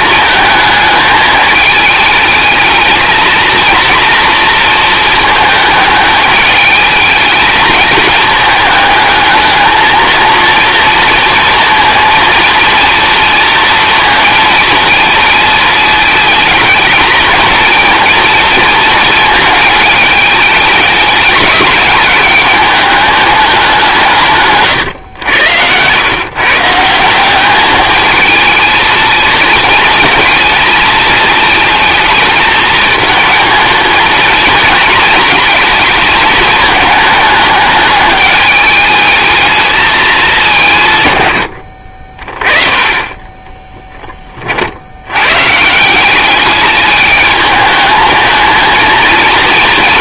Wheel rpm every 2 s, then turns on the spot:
220, 220, 230, 210, 210, 230, 230, 230, 220, 230, 210, 200, 140, 150, 220, 220, 220, 230, 210, 210, 170, 20, 60, 210, 230.
none